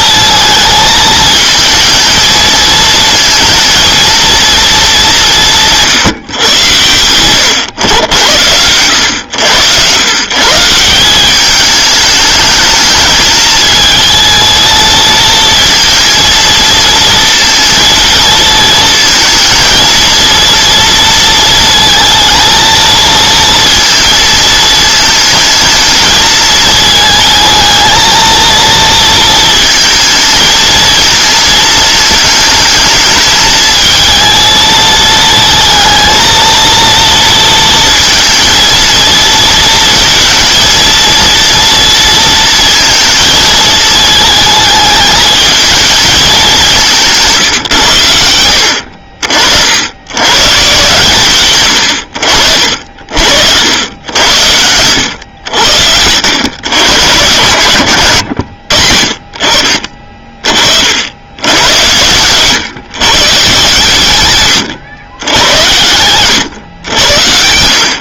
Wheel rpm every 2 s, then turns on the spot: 220, 220, 230, 120, 90, 150, 210, 220, 230, 230, 230, 230, 220, 220, 230, 220, 220, 220, 230, 230, 230, 230, 220, 200, 80, 130, 70, 90, 110, 70, 40, 120, 120, 110.
48-50